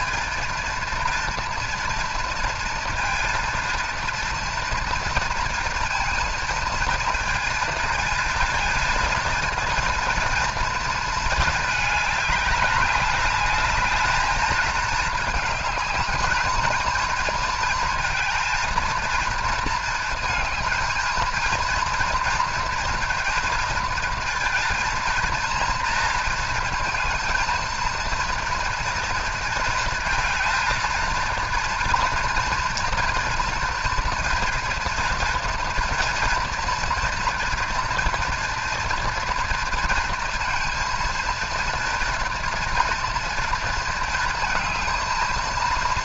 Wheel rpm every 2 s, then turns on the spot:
230, 230, 240, 230, 230, 230, 210, 220, 230, 230, 230, 240, 230, 230, 230, 230, 230, 240, 240, 230, 230, 230, 230.
none